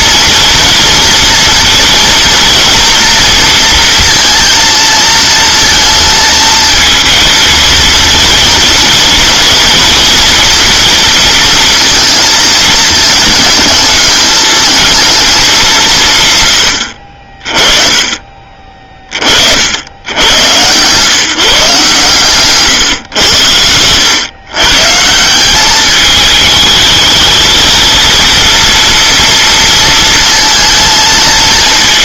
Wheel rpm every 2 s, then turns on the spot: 230, 240, 230, 230, 230, 230, 220, 220, 70, 40, 120, 130, 140, 220, 230, 230.
none